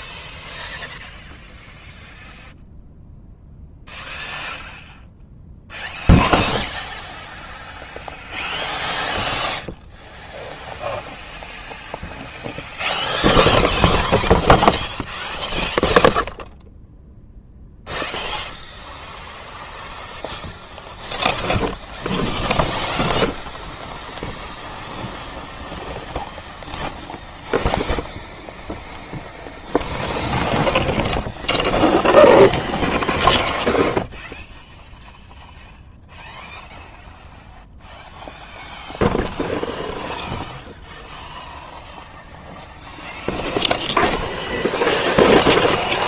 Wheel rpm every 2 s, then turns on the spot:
0, 0, 0, 0, 0, 0, 0, 0, 0, 0, 0, 0, 0, 0, 0, 0, 0, 0, 0, 0, 0, 0, 0.
none